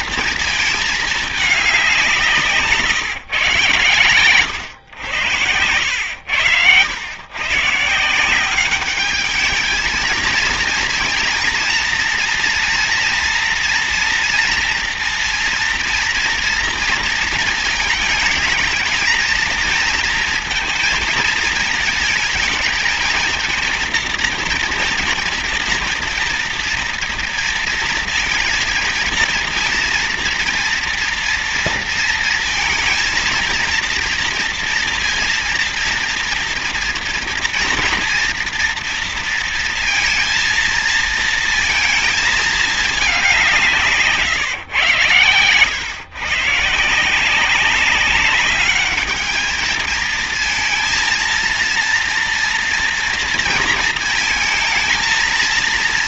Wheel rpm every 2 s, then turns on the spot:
220, 150, 110, 90, 190, 230, 230, 230, 230, 220, 230, 220, 230, 230, 230, 230, 230, 230, 240, 230, 230, 210, 140, 170, 210, 230, 230, 230.
none